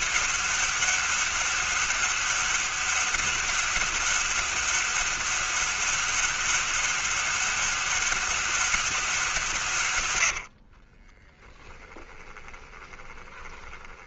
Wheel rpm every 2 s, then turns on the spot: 200, 200, 200, 200, 190, 50, 20.
10-14